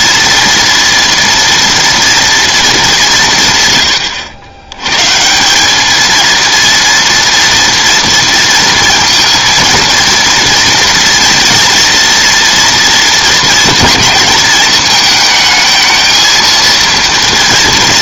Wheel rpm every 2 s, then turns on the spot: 230, 200, 110, 230, 230, 230, 230, 220, 230.
none